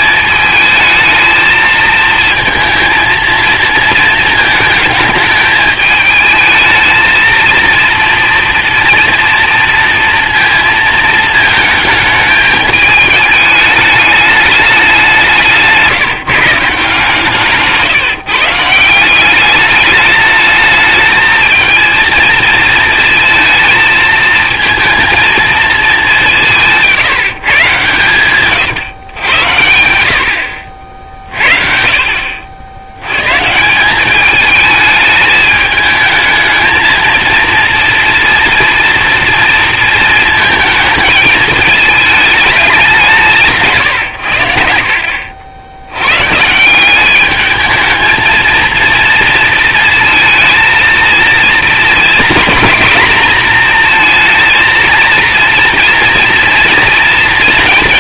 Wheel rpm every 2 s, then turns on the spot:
220, 230, 220, 220, 230, 230, 220, 200, 150, 160, 220, 230, 220, 160, 130, 70, 80, 210, 220, 240, 220, 210, 80, 170, 230, 230, 240, 230, 230.
none